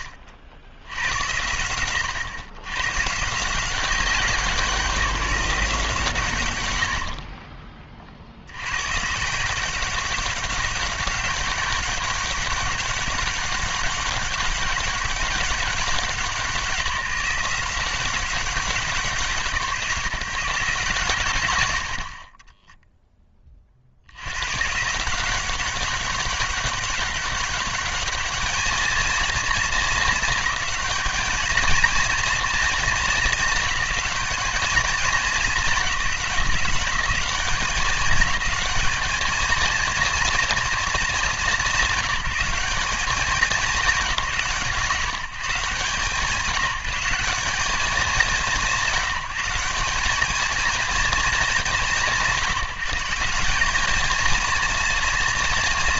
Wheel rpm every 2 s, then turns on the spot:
60, 140, 180, 70, 150, 190, 200, 200, 170, 170, 120, 10, 170, 200, 230, 210, 220, 220, 170, 220, 220, 200, 150, 180, 170, 220, 180, 230.
6-8